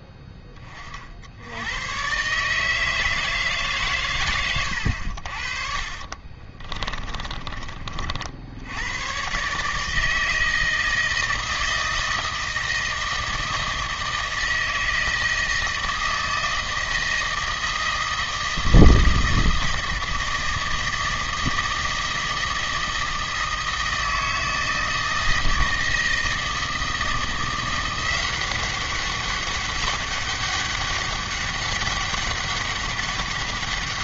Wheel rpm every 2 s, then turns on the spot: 20, 160, 90, 30, 90, 160, 160, 160, 160, 160, 160, 160, 160, 160, 190, 200, 200.
4-8